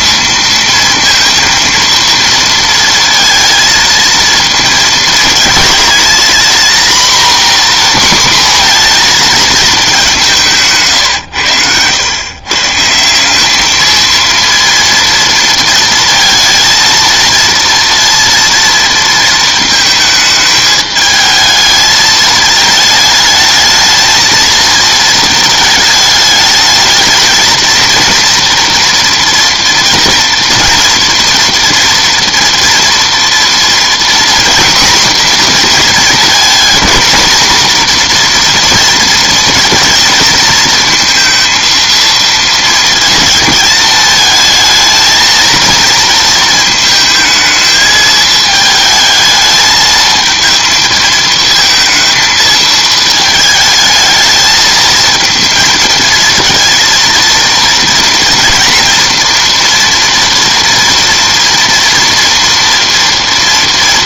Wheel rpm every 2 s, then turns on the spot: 230, 230, 220, 230, 240, 160, 140, 230, 230, 230, 210, 220, 220, 210, 230, 230, 230, 240, 230, 240, 230, 230, 220, 230, 220, 220, 220, 220, 230, 240, 230, 230.
none